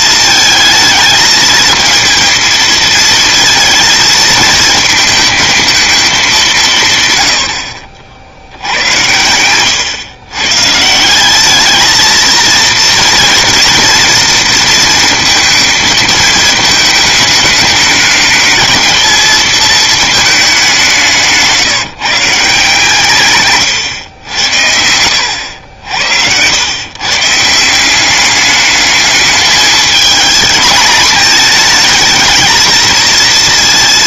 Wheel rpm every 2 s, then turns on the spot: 220, 230, 230, 160, 70, 140, 230, 230, 220, 220, 190, 160, 90, 110, 210, 230, 220.
none